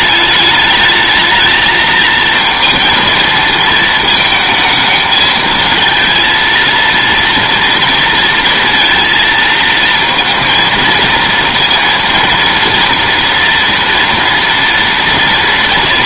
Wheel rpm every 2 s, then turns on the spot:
210, 230, 220, 230, 230, 230, 230, 230.
none